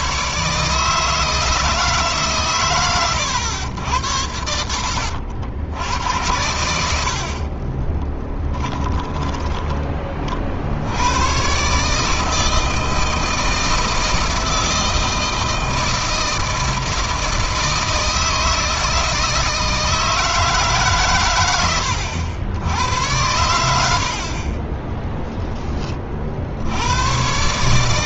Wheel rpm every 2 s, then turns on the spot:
160, 110, 70, 60, 10, 90, 160, 160, 160, 160, 130, 100, 10, 100.
8-10 24-26